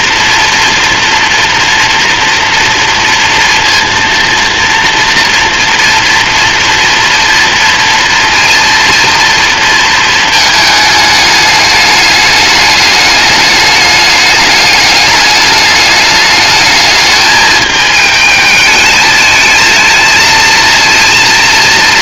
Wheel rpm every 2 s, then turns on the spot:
230, 230, 230, 230, 230, 210, 210, 210, 220, 220, 230.
none